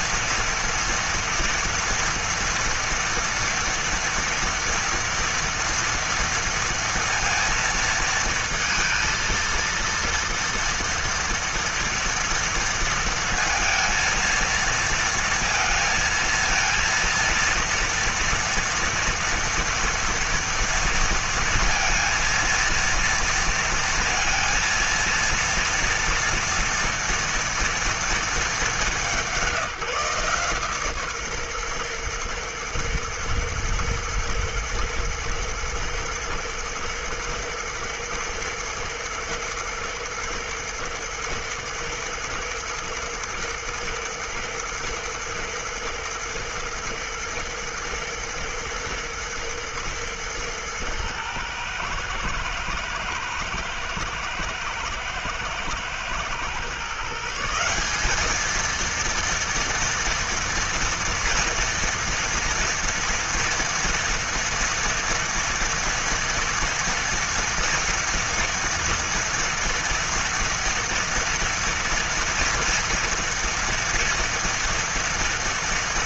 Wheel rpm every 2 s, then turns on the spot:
230, 230, 230, 230, 230, 230, 230, 230, 230, 230, 230, 230, 230, 230, 200, 150, 120, 110, 110, 120, 120, 120, 120, 120, 110, 110, 110, 110, 130, 220, 230, 230, 230, 230, 230, 230, 230, 230.
none